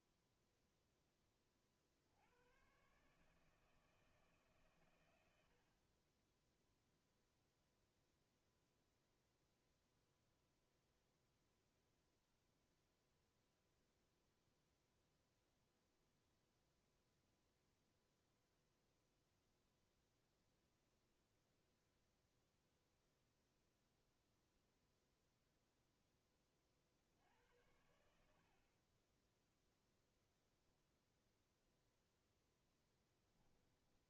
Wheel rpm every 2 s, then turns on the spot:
0, 110, 140, 10, 0, 0, 0, 0, 0, 0, 0, 0, 0, 30, 60, 0, 0.
none